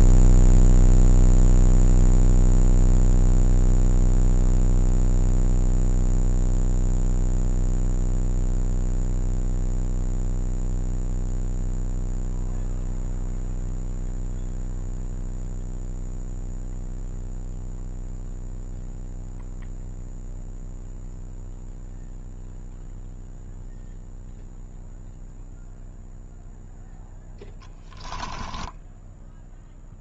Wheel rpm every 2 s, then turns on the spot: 0, 0, 0, 0, 0, 0, 0, 0, 0, 0, 0, 0, 0, 0, 10.
28-30